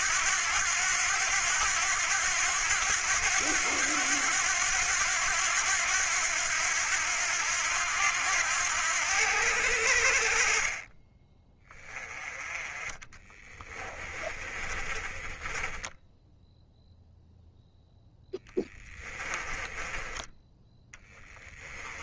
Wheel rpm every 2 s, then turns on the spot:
90, 90, 90, 90, 90, 30, 20, 30, 0, 10, 10.
10-12 14-16 18-20